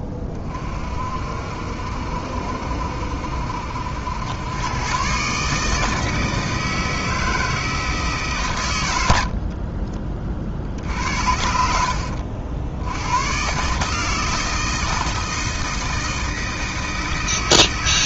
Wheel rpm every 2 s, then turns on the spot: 40, 70, 110, 160, 110, 60, 80, 160, 160.
none